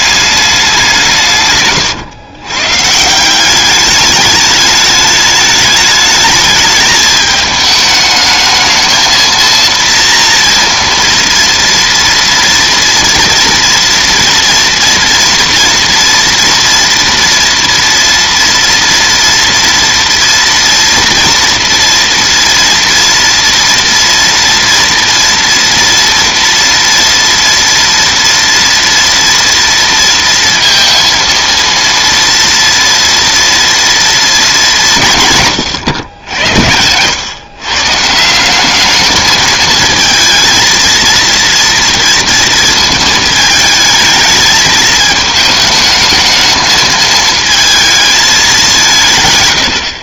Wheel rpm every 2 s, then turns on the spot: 190, 130, 210, 210, 220, 230, 230, 230, 230, 230, 230, 230, 230, 230, 230, 230, 230, 200, 90, 190, 220, 220, 220, 220, 180.
none